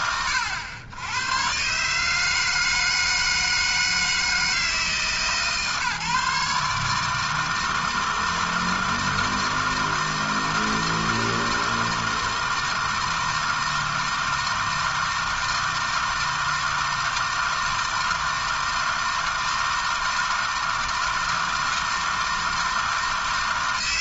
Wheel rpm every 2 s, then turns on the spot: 90, 160, 160, 150, 160, 160, 160, 160, 160, 160, 160, 160.
none